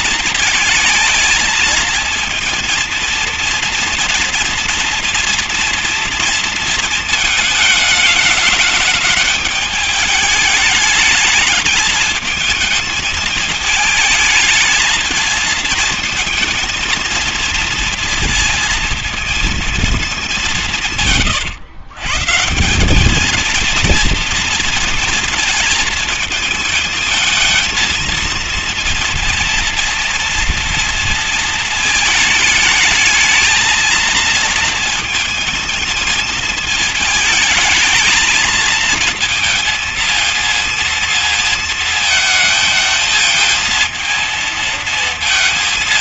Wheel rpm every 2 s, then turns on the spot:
210, 230, 230, 230, 210, 210, 220, 220, 220, 230, 170, 180, 230, 220, 230, 230, 210, 230, 220, 220, 230, 220, 220.
none